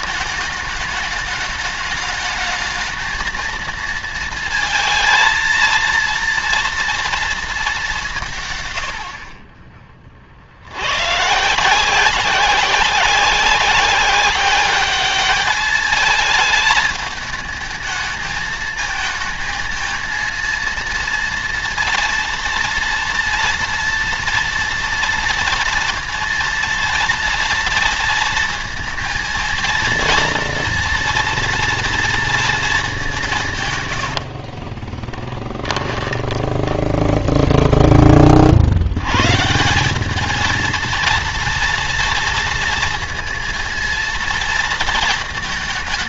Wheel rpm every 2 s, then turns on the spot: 220, 220, 230, 230, 70, 100, 190, 200, 220, 220, 230, 230, 230, 230, 230, 230, 190, 20, 0, 80, 230, 230, 220.
34-36